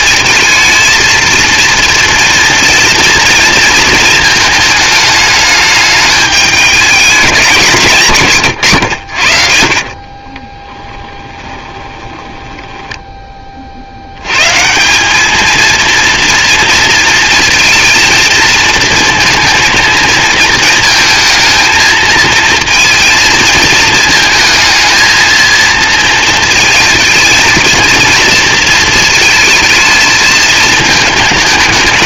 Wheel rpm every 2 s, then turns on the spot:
220, 230, 220, 210, 90, 20, 10, 150, 230, 230, 230, 230, 220, 230, 230, 220.
10-14